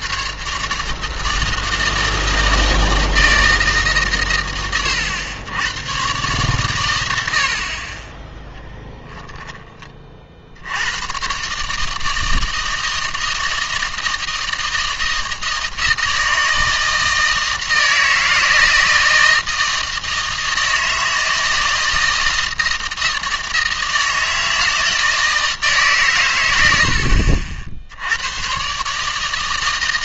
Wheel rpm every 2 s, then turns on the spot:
150, 160, 110, 120, 10, 80, 160, 160, 160, 160, 160, 160, 160, 80, 140.
none